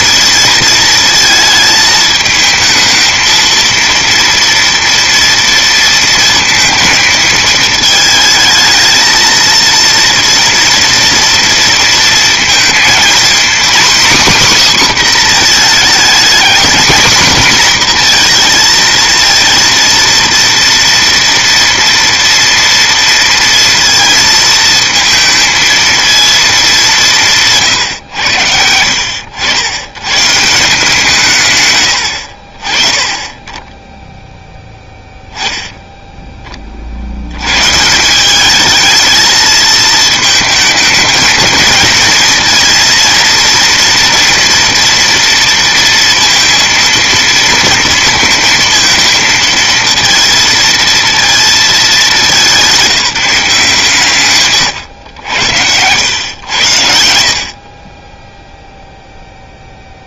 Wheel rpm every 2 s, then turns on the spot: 220, 220, 230, 220, 220, 230, 220, 270, 240, 230, 230, 230, 230, 210, 90, 170, 50, 0, 30, 210, 220, 230, 240, 230, 230, 230, 200, 130, 110, 0.
none